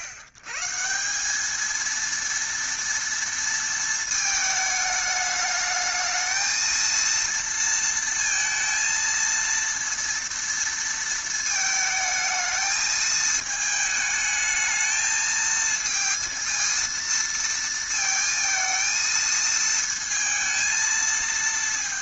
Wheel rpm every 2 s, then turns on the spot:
120, 230, 220, 230, 230, 230, 220, 220, 230, 220, 220.
none